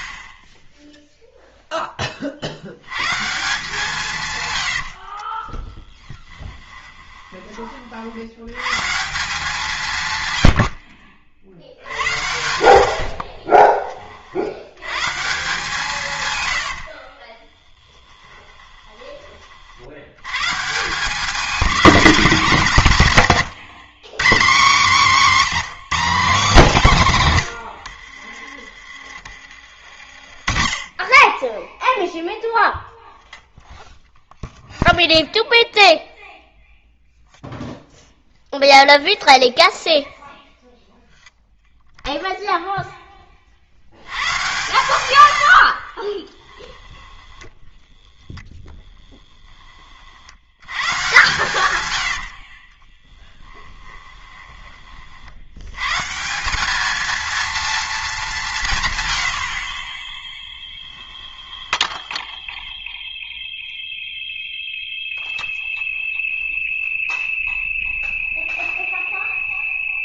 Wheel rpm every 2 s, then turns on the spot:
0, 80, 100, 20, 130, 90, 70, 90, 80, 20, 160, 200, 230, 210, 30, 30, 0, 0, 0, 0, 0, 0, 120, 10, 10, 100, 40, 30, 200, 150, 10, 0, 0, 0, 0.
4-8 12-14 16-20 46-50 52-54 60-62